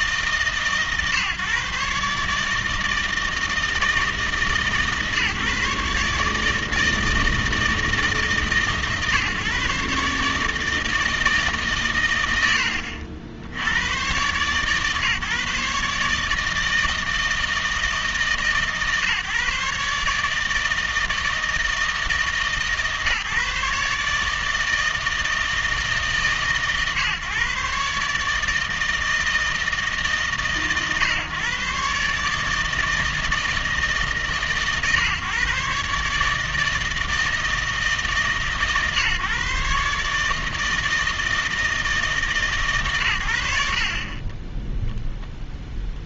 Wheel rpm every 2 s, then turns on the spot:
140, 160, 140, 160, 140, 160, 80, 140, 160, 140, 160, 150, 160, 140, 160, 140, 160, 130, 160, 150, 160, 130, 0.
none